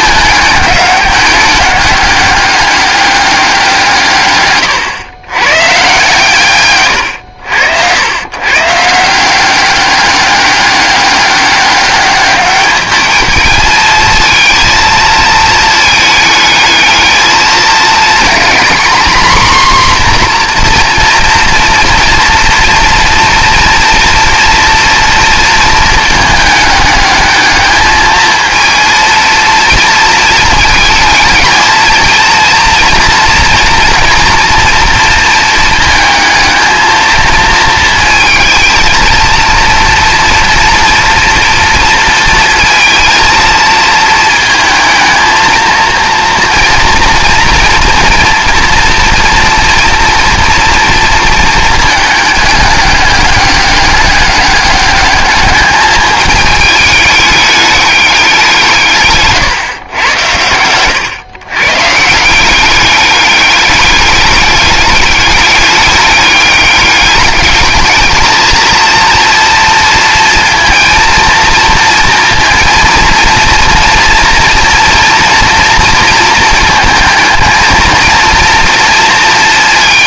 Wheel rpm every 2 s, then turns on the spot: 200, 200, 110, 130, 150, 200, 210, 220, 220, 240, 240, 230, 230, 210, 230, 220, 230, 230, 220, 230, 230, 230, 220, 240, 230, 230, 210, 200, 210, 170, 110, 190, 210, 200, 230, 230, 230, 230, 230, 230.
6-8